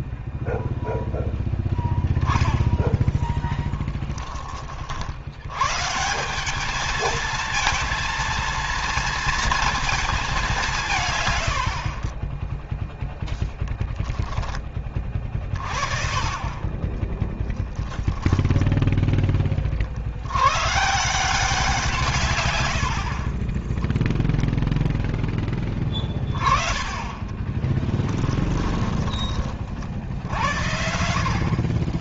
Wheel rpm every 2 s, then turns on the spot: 0, 10, 40, 210, 230, 160, 0, 10, 20, 10, 150, 60, 10, 30, 20, 70.
16-20 28-30